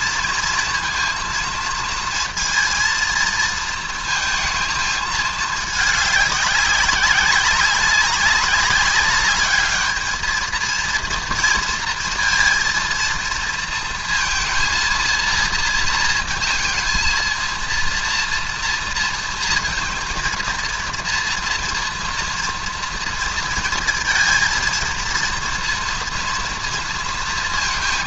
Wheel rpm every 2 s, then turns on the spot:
230, 230, 230, 200, 200, 220, 230, 230, 230, 230, 230, 230, 230, 230.
none